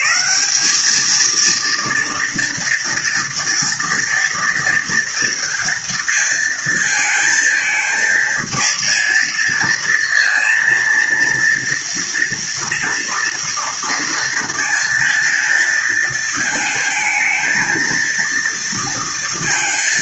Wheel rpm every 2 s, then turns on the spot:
190, 230, 240, 230, 220, 230, 230, 230, 220, 230.
none